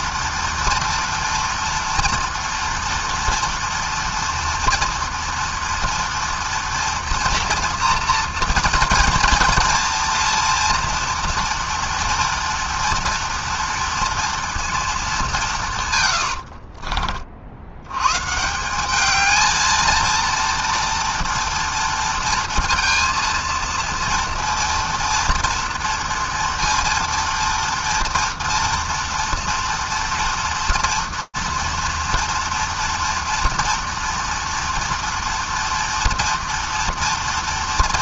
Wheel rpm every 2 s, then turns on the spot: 230, 230, 230, 230, 230, 230, 240, 230, 80, 160, 230, 230, 230, 230, 230, 230, 230, 230, 230.
16-18